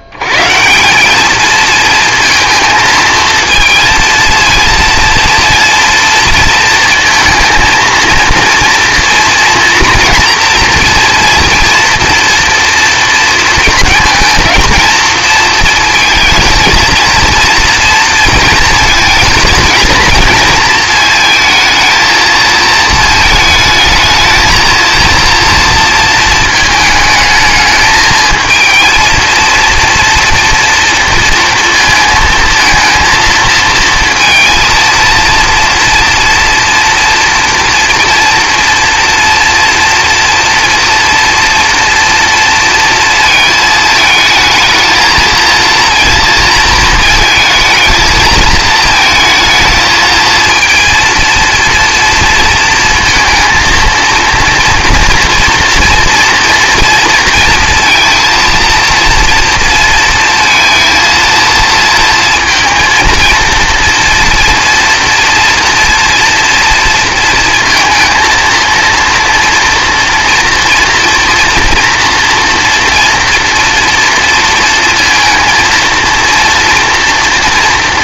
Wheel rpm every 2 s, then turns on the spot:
170, 230, 230, 230, 230, 230, 230, 220, 230, 220, 220, 220, 220, 220, 220, 230, 230, 230, 230, 230, 240, 230, 220, 230, 220, 230, 230, 230, 230, 230, 230, 230, 230, 230, 230, 230, 230, 230, 230.
none